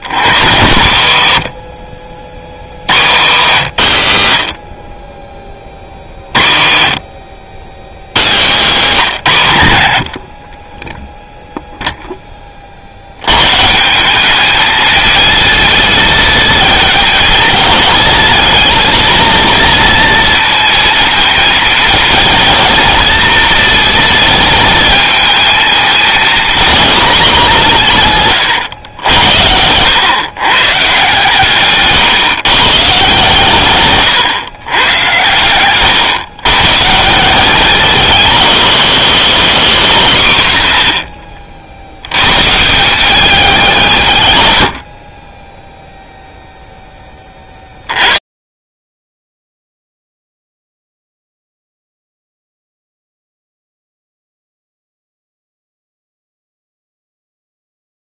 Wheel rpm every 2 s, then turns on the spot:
100, 80, 50, 40, 140, 10, 40, 220, 220, 220, 230, 230, 220, 220, 110, 140, 140, 120, 140, 210, 80, 170, 80, 10, 30, 0, 0, 0, 0.
0-2 8-10 44-46